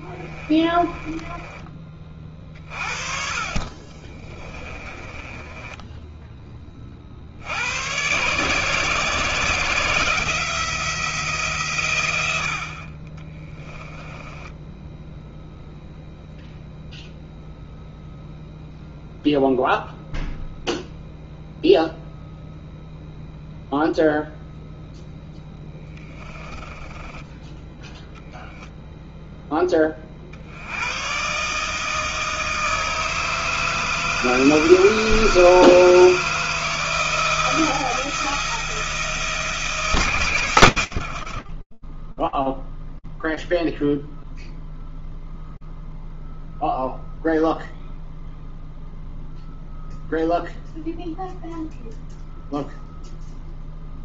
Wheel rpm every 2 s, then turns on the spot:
20, 40, 20, 70, 160, 150, 20, 0, 0, 0, 0, 0, 0, 10, 10, 130, 160, 160, 170, 160, 60, 0, 0, 0, 0, 0, 0.
0-2 4-6 12-14 40-42